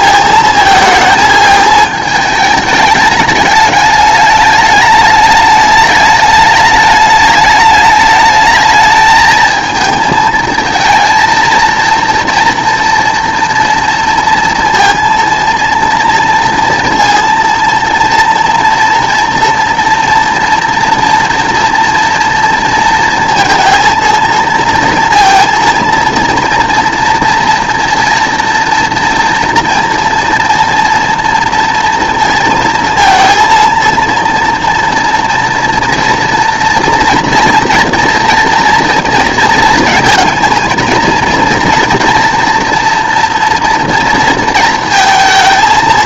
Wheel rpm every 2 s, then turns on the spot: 220, 210, 210, 210, 210, 230, 240, 230, 230, 230, 230, 230, 230, 230, 230, 230, 230, 240, 230, 230, 230, 230, 230.
none